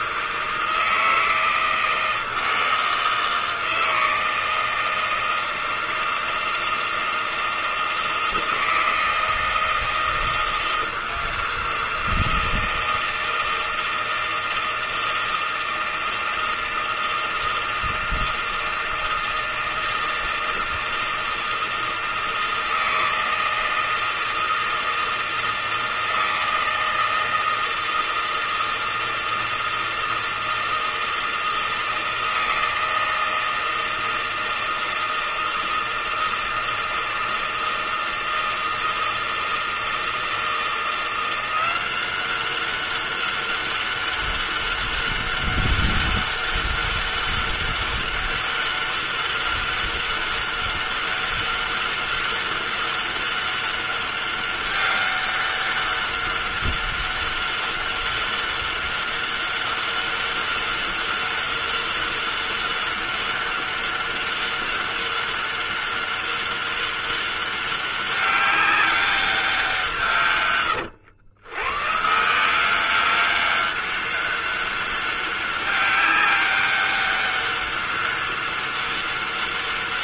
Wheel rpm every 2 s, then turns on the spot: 160, 160, 160, 160, 160, 160, 160, 160, 160, 160, 160, 160, 160, 160, 160, 160, 160, 160, 160, 160, 170, 190, 200, 200, 200, 200, 200, 200, 200, 200, 200, 200, 200, 200, 200, 110, 180, 200, 200, 200.
none